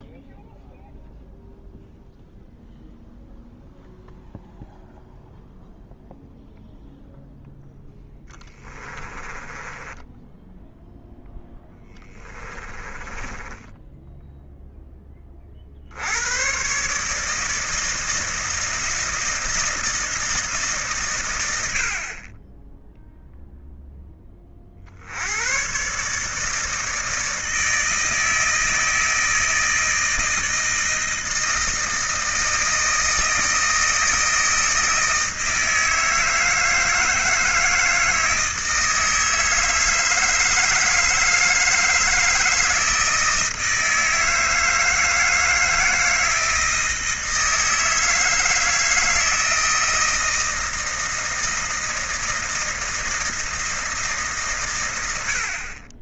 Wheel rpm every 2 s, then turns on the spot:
0, 0, 0, 0, 20, 0, 20, 0, 130, 160, 150, 10, 40, 160, 160, 160, 160, 160, 160, 160, 160, 160, 160, 160, 160, 160, 160, 130.
8-10 12-14